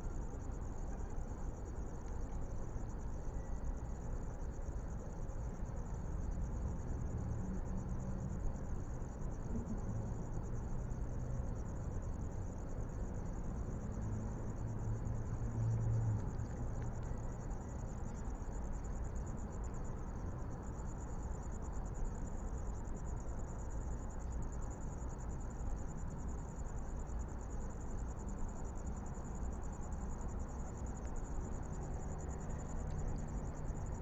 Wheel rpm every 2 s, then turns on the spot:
0, 0, 0, 0, 0, 0, 0, 0, 0, 0, 0, 0, 0, 0, 0, 0, 0.
none